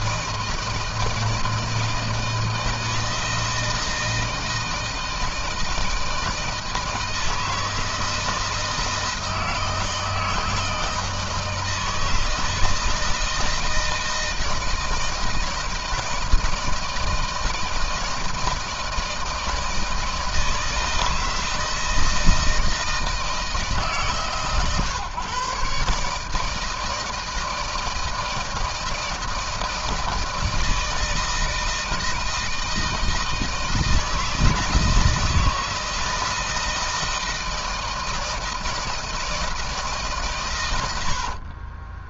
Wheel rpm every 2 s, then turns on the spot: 160, 160, 160, 160, 160, 160, 160, 160, 160, 160, 160, 160, 130, 160, 160, 160, 160, 160, 160, 160, 100.
40-42